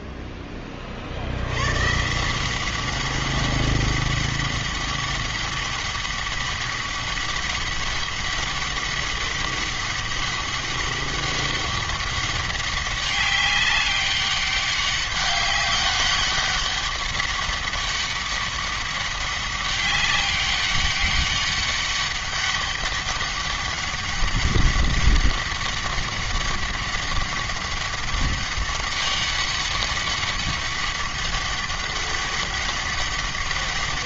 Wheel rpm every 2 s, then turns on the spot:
40, 190, 200, 200, 200, 200, 190, 200, 200, 200, 200, 200, 200, 200, 200, 200, 200.
none